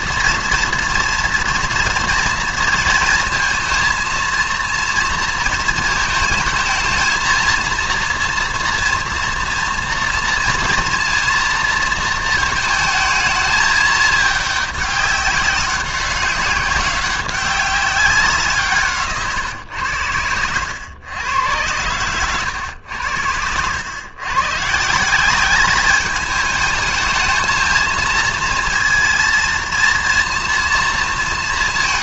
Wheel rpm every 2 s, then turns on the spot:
230, 230, 230, 220, 230, 230, 220, 200, 190, 170, 100, 100, 150, 220, 230, 230.
none